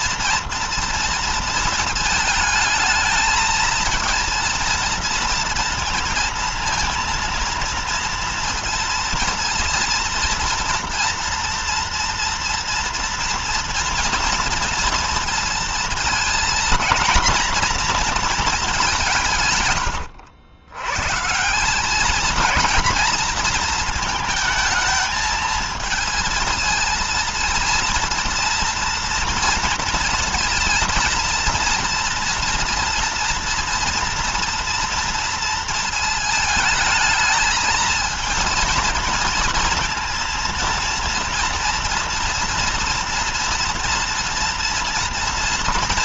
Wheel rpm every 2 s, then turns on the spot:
230, 220, 230, 230, 230, 230, 230, 230, 230, 220, 90, 220, 220, 220, 230, 230, 240, 230, 220, 230, 230, 230, 230.
none